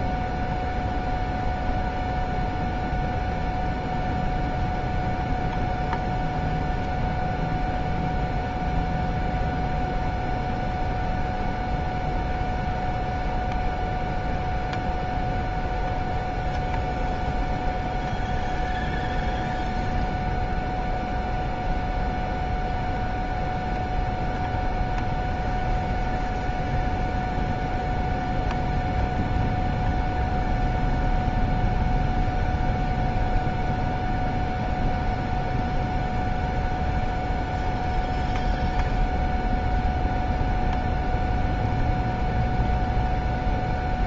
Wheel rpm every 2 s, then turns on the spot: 0, 0, 0, 0, 0, 0, 0, 0, 0, 0, 0, 0, 0, 0, 0, 0, 0, 0, 0, 0, 0, 0.
none